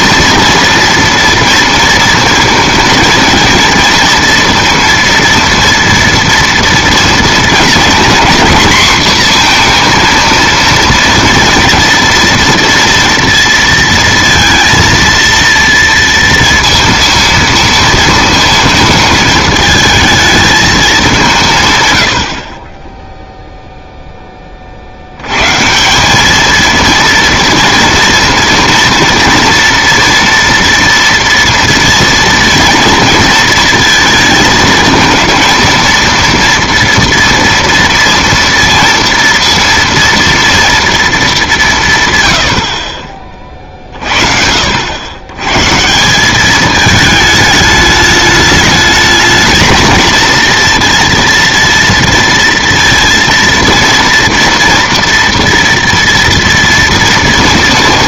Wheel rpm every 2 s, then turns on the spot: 230, 220, 230, 230, 250, 230, 230, 230, 230, 220, 210, 10, 60, 230, 240, 230, 230, 220, 230, 230, 230, 50, 70, 210, 220, 230, 230, 230, 230.
none